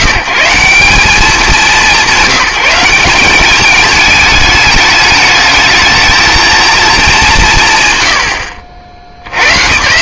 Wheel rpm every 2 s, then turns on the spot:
160, 190, 210, 220, 80.
none